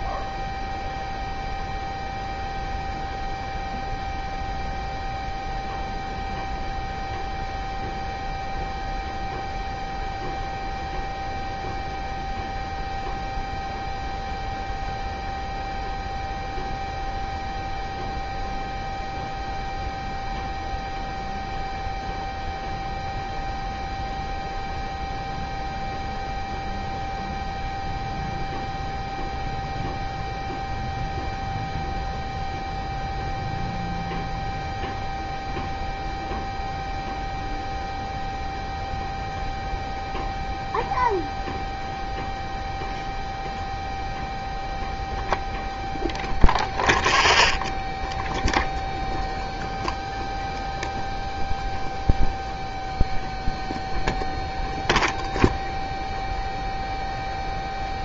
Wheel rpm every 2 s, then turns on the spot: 0, 0, 0, 0, 0, 0, 0, 0, 0, 0, 0, 0, 0, 0, 0, 0, 0, 0, 0, 0, 0, 0, 0, 0, 0, 0, 0, 0, 0.
none